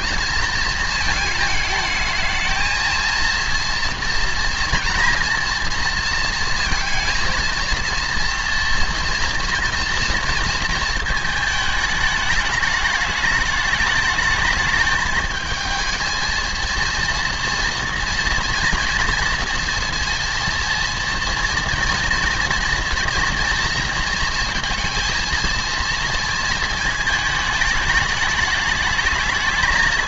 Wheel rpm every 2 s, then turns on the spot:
220, 220, 240, 230, 230, 230, 210, 220, 230, 240, 230, 230, 230, 220, 210.
none